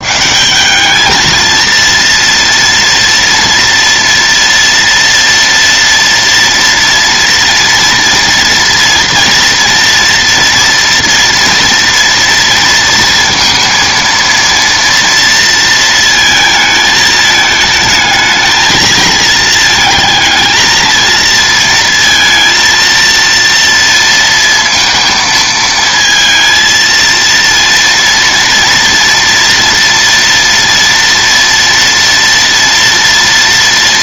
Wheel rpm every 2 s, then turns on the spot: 190, 230, 230, 230, 240, 230, 230, 230, 220, 220, 230, 230, 230, 230, 230, 230, 230.
none